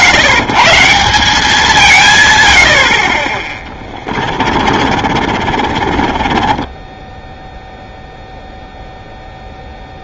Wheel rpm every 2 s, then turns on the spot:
130, 90, 40, 20, 0.
4-8